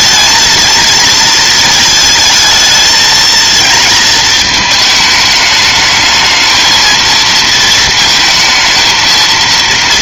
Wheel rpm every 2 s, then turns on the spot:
230, 220, 220, 220, 220.
none